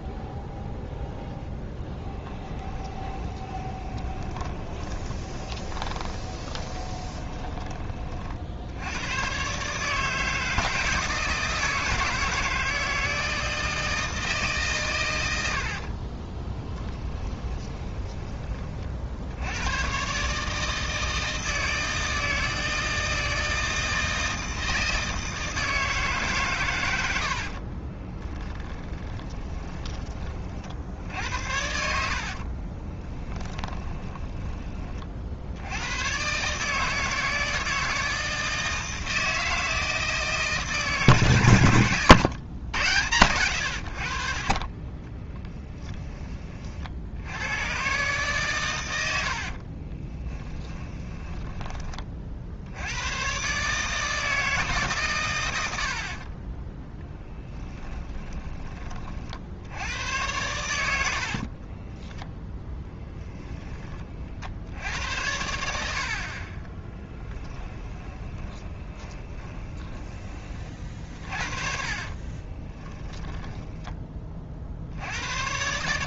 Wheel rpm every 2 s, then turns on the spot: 0, 20, 20, 20, 90, 160, 160, 130, 10, 50, 160, 160, 160, 100, 10, 60, 20, 30, 150, 160, 160, 100, 20, 60, 100, 10, 90, 150, 10, 30, 80, 0, 80, 10, 20, 50, 10, 70.
2-8 16-18 28-30 32-34 44-46 48-52 66-70 72-74